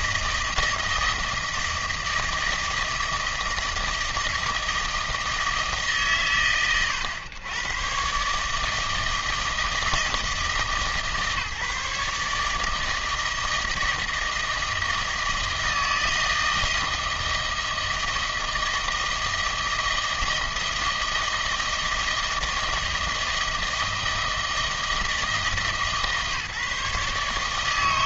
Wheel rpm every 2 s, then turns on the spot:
160, 160, 160, 120, 150, 150, 150, 160, 160, 160, 160, 160, 160, 150.
none